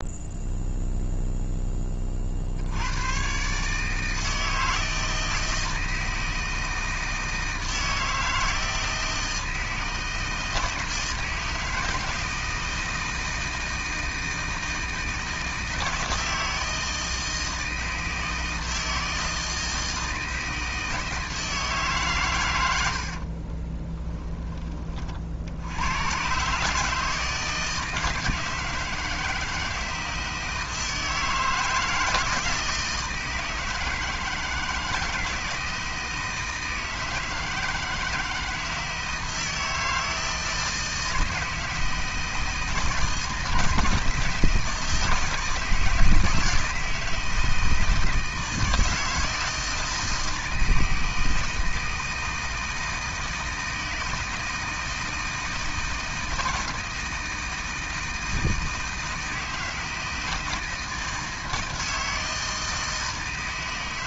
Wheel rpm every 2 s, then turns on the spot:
0, 60, 160, 160, 160, 160, 160, 160, 160, 160, 160, 110, 20, 130, 160, 160, 160, 160, 160, 160, 160, 160, 160, 160, 160, 160, 160, 160, 160, 160, 160, 160.
none